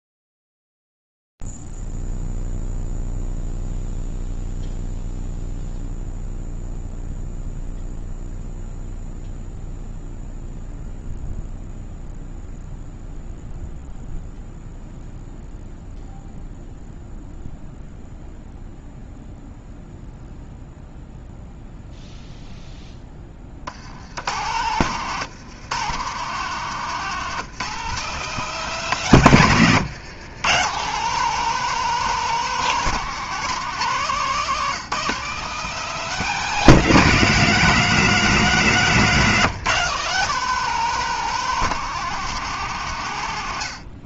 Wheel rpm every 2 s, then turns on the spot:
0, 0, 0, 0, 0, 0, 0, 0, 0, 0, 0, 0, 70, 150, 180, 130, 190, 170, 180, 170, 160, 180.
none